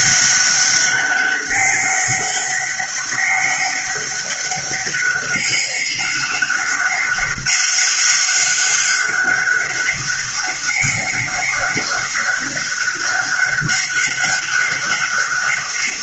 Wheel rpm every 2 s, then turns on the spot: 190, 200, 200, 200, 200, 200, 200, 200.
none